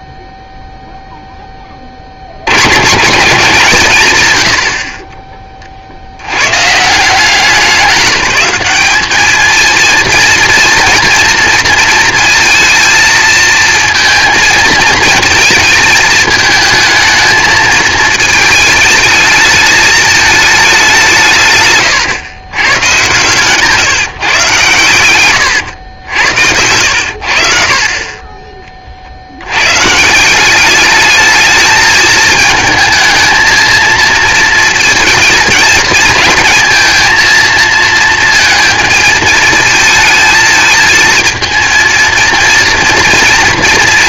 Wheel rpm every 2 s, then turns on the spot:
0, 120, 90, 130, 210, 230, 230, 220, 220, 220, 200, 110, 120, 80, 30, 200, 220, 220, 220, 220, 220, 230.
none